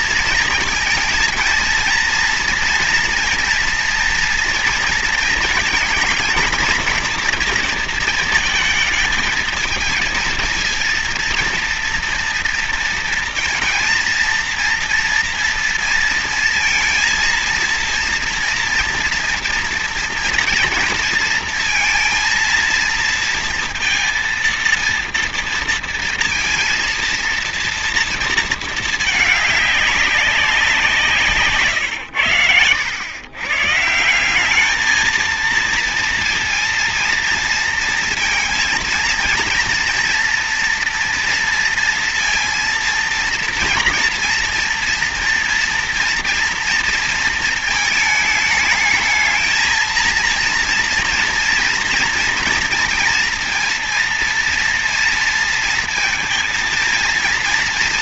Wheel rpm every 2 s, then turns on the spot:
230, 230, 230, 230, 220, 230, 230, 230, 230, 230, 230, 230, 230, 230, 230, 200, 130, 180, 230, 230, 230, 230, 230, 230, 220, 230, 230, 230, 230.
none